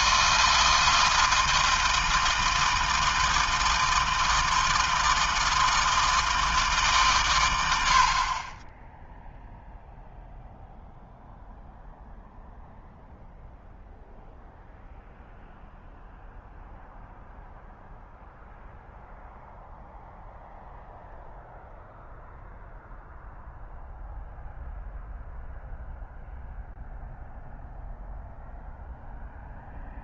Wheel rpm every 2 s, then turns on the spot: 160, 160, 160, 160, 40, 0, 0, 0, 0, 0, 0, 0, 0, 0, 0.
none